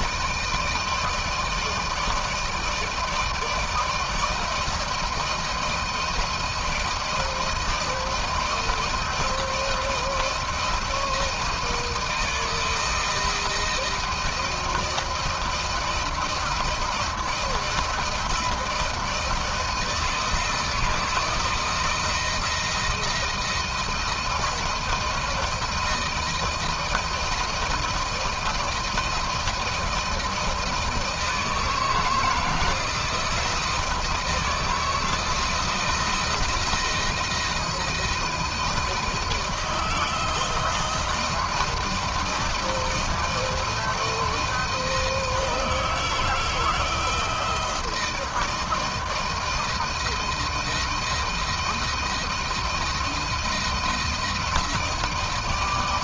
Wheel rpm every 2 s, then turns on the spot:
160, 160, 160, 170, 170, 160, 160, 160, 160, 170, 160, 160, 160, 160, 170, 160, 160, 160, 170, 170, 160, 170, 170, 160, 160, 160, 160, 170.
none